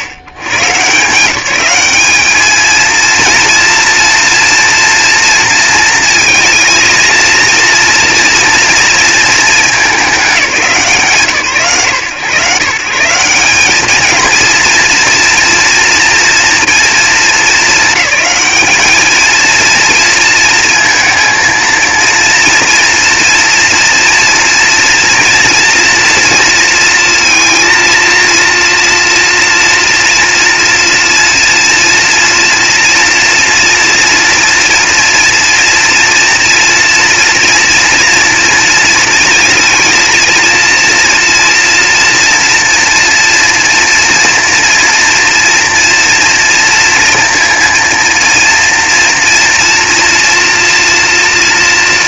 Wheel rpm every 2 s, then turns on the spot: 120, 210, 230, 220, 230, 190, 140, 230, 230, 200, 230, 230, 230, 230, 230, 230, 230, 240, 230, 230, 230, 230, 230, 230, 230, 230.
none